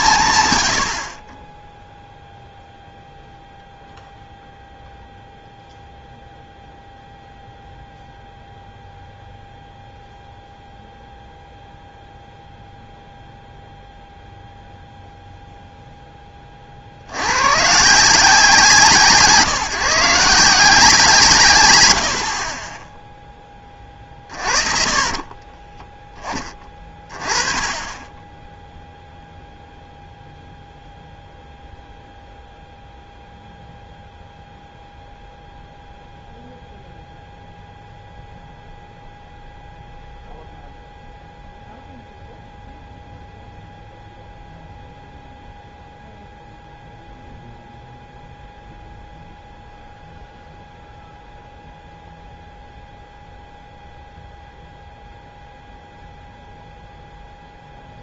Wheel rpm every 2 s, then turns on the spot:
90, 0, 0, 0, 0, 0, 0, 0, 50, 160, 180, 20, 30, 30, 0, 0, 0, 0, 0, 0, 0, 0, 0, 0, 0, 0, 0, 0, 0.
24-26